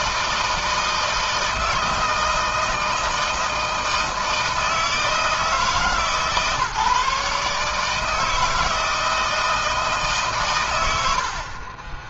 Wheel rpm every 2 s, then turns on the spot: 160, 160, 160, 140, 160, 120.
none